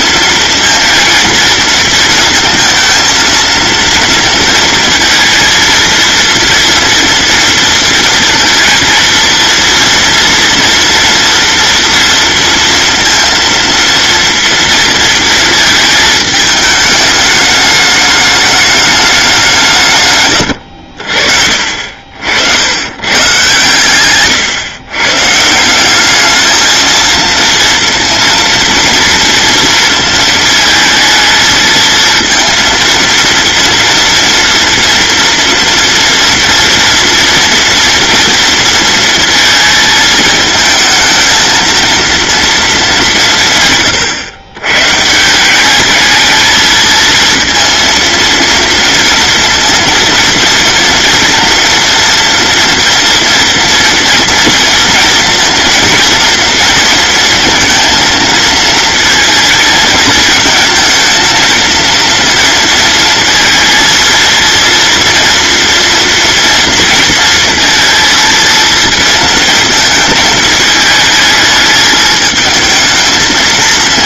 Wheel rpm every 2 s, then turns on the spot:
230, 220, 230, 230, 230, 240, 230, 230, 210, 210, 70, 100, 130, 220, 230, 220, 230, 230, 230, 230, 220, 200, 130, 220, 230, 230, 240, 230, 230, 230, 220, 230, 230, 230, 230, 220, 220.
20-22